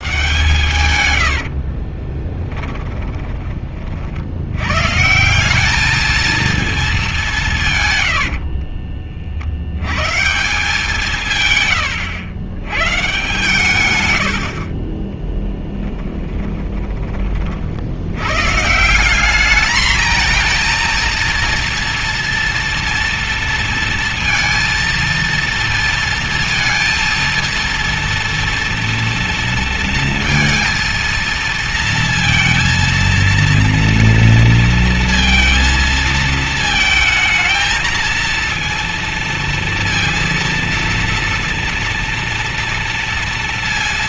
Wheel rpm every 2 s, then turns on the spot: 100, 20, 150, 210, 50, 150, 130, 30, 30, 180, 230, 230, 230, 230, 230, 230, 230, 230, 220, 230, 230, 230.
0-4 14-16